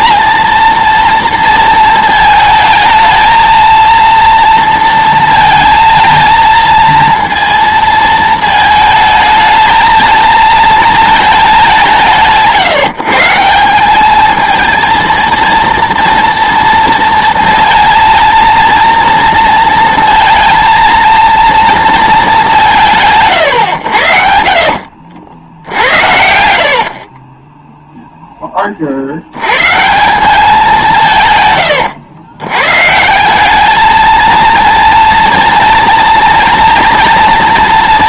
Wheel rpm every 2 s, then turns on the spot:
230, 220, 230, 230, 220, 220, 150, 220, 240, 230, 230, 170, 70, 60, 30, 190, 130, 230, 230.
24-28